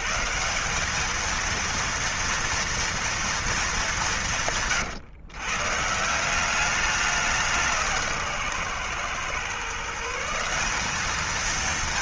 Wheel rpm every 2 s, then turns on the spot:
130, 230, 190, 150, 170, 160.
none